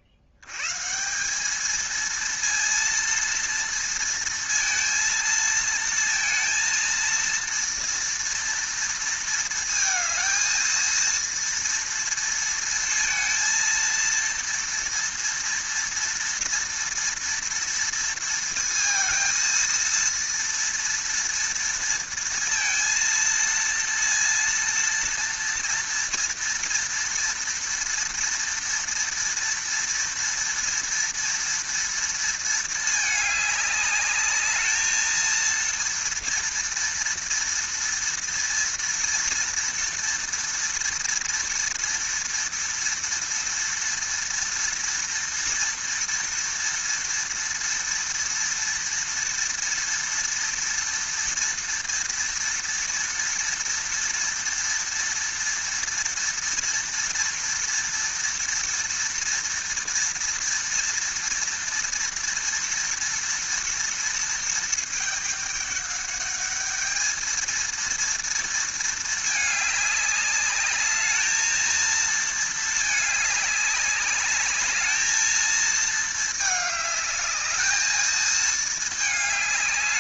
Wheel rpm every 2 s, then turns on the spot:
120, 230, 230, 230, 230, 230, 230, 230, 230, 230, 230, 230, 230, 230, 230, 230, 220, 210, 230, 230, 230, 230, 230, 230, 230, 230, 230, 230, 230, 230, 230, 230, 220, 210, 230, 210, 220, 210, 210, 220.
none